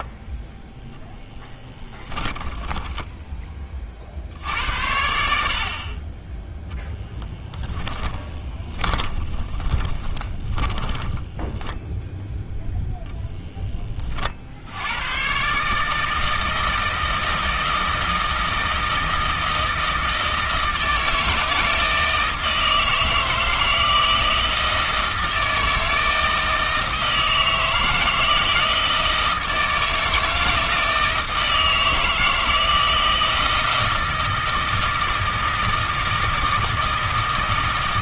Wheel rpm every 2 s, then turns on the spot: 0, 10, 80, 10, 20, 20, 0, 80, 160, 160, 160, 160, 160, 160, 160, 160, 160, 160, 160.
2-4 6-12